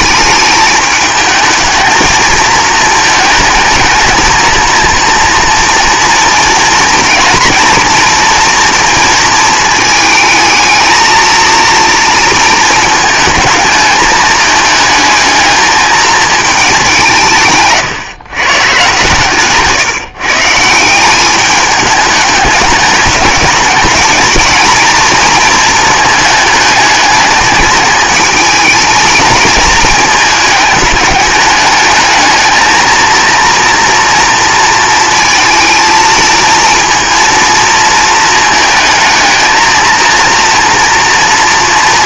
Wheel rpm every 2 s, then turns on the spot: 210, 220, 230, 230, 230, 220, 230, 220, 200, 130, 170, 210, 220, 210, 220, 210, 220, 230, 230, 220, 230.
none